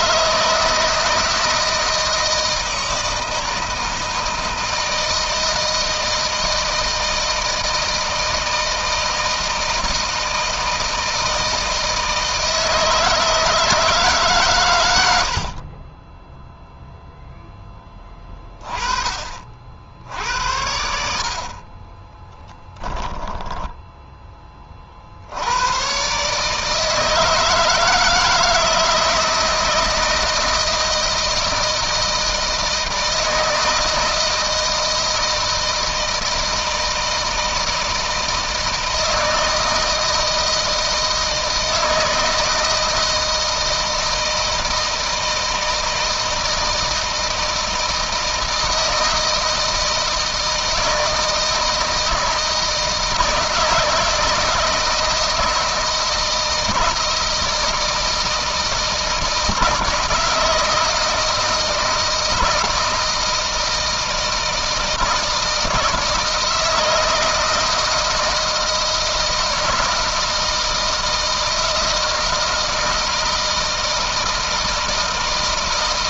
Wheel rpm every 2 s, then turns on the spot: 160, 160, 160, 160, 160, 160, 160, 70, 0, 30, 60, 10, 60, 160, 160, 160, 160, 160, 160, 160, 160, 160, 160, 160, 160, 160, 160, 160, 160, 160, 160, 160, 160, 160, 160, 160, 160, 160.
22-24